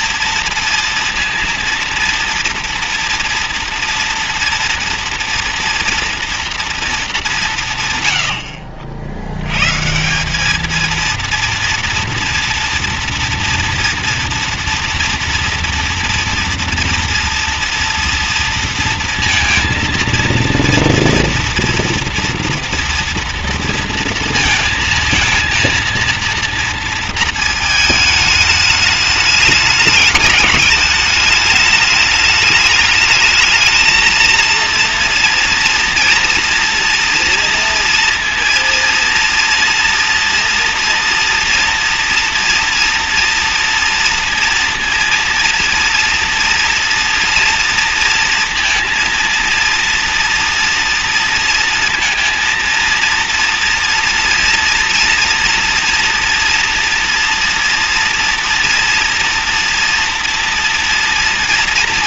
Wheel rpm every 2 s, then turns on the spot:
230, 230, 240, 230, 70, 220, 230, 240, 230, 230, 240, 230, 230, 230, 210, 210, 210, 230, 230, 230, 230, 230, 230, 240, 230, 230, 230, 240, 230, 230, 230.
none